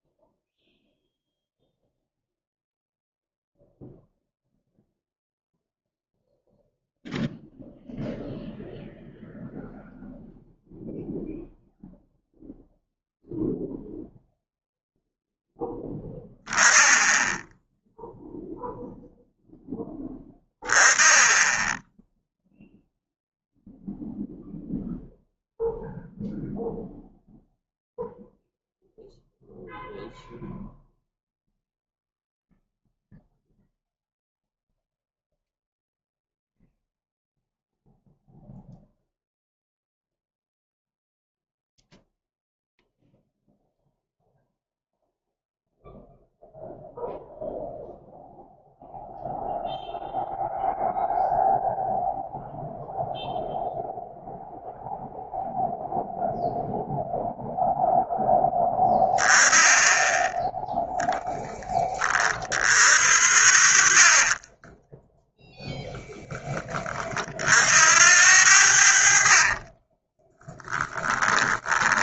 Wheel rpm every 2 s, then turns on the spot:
0, 0, 0, 0, 0, 0, 0, 0, 0, 0, 10, 0, 0, 0, 0, 0, 0, 0, 0, 0, 0, 0, 0, 0, 0, 0, 0, 0, 0, 10, 0, 50, 10, 30, 60, 10.
64-66 68-70